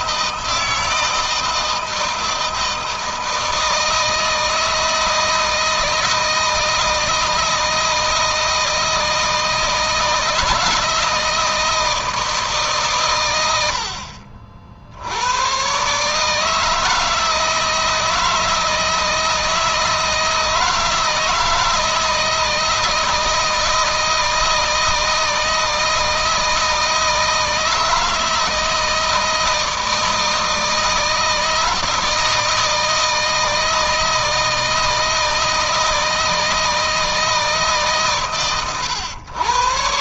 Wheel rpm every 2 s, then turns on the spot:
160, 160, 160, 160, 160, 160, 130, 70, 160, 160, 160, 160, 160, 160, 160, 160, 160, 160, 160, 130.
none